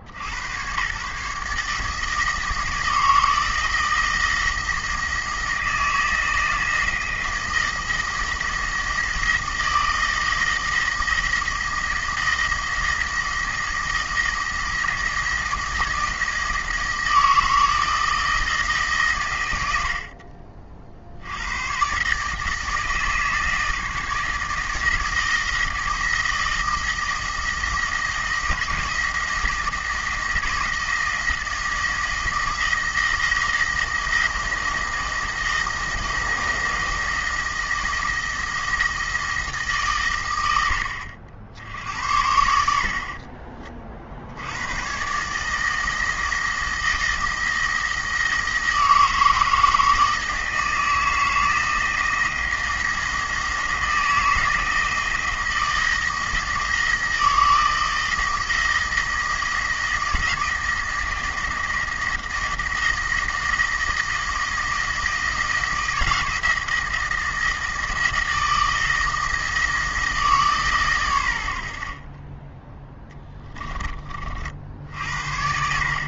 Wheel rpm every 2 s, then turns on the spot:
90, 160, 160, 160, 160, 170, 170, 160, 160, 150, 50, 160, 160, 160, 160, 160, 170, 160, 160, 170, 80, 60, 110, 160, 160, 160, 160, 160, 160, 170, 160, 160, 160, 160, 160, 140, 10, 70.
none